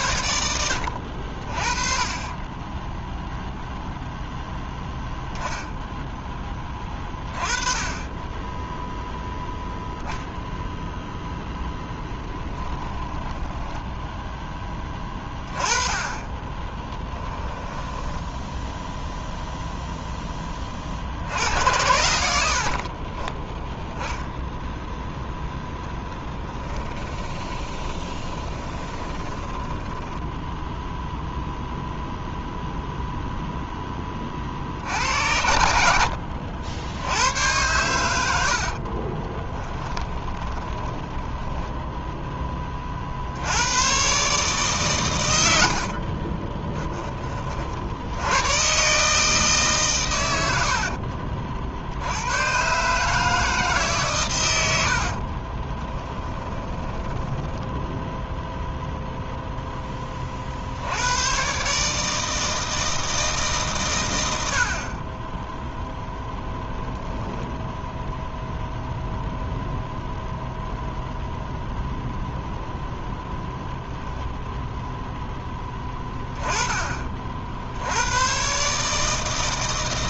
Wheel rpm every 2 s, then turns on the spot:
70, 10, 10, 20, 0, 0, 10, 10, 10, 0, 40, 40, 0, 20, 20, 0, 0, 60, 80, 50, 10, 30, 130, 10, 130, 60, 140, 70, 10, 0, 70, 160, 30, 10, 0, 0, 0, 0, 30, 140.
12-14 16-18 26-30 38-42 50-52 56-58